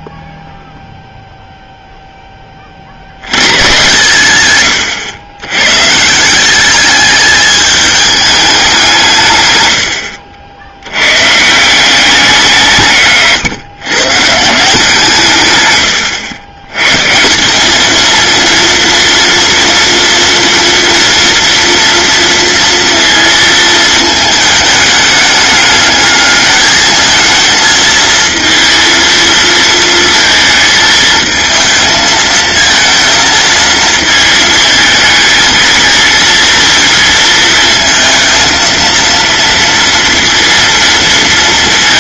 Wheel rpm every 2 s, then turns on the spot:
0, 100, 110, 210, 150, 110, 140, 140, 150, 230, 230, 230, 210, 220, 230, 220, 230, 220, 230, 230, 230.
none